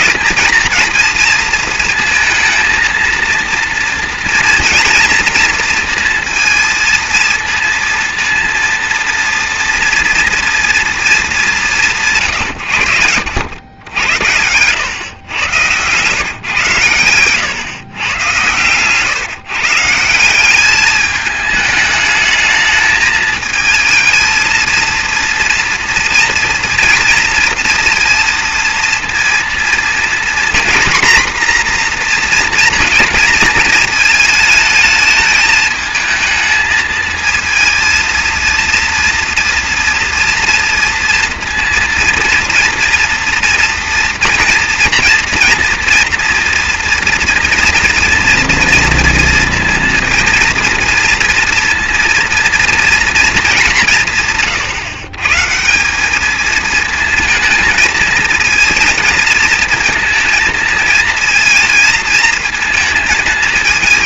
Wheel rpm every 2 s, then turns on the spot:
230, 230, 230, 230, 230, 230, 100, 100, 130, 110, 200, 210, 230, 230, 230, 240, 230, 220, 220, 230, 230, 230, 230, 230, 230, 230, 230, 140, 220, 230, 230, 230.
none